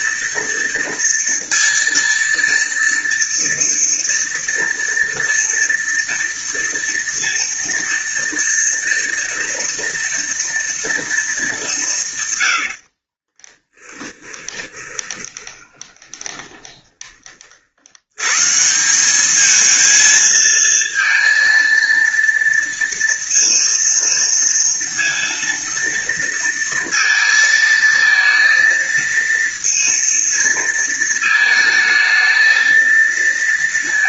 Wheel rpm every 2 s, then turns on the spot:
230, 230, 230, 230, 230, 230, 90, 20, 20, 180, 230, 230, 230, 230, 230, 230, 230.
12-18